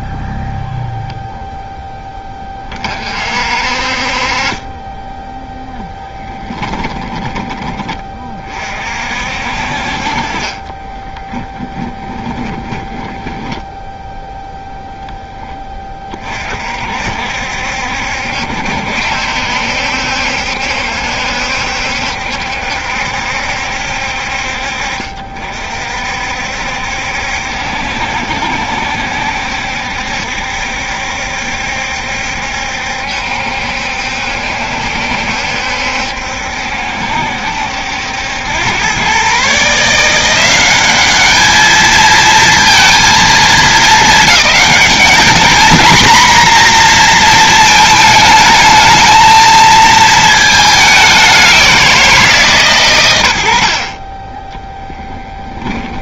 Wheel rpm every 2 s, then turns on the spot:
0, 40, 10, 20, 50, 20, 10, 10, 60, 70, 70, 70, 50, 70, 70, 70, 70, 70, 70, 120, 210, 230, 220, 230, 220, 190, 130, 10.
6-8 10-14 54-56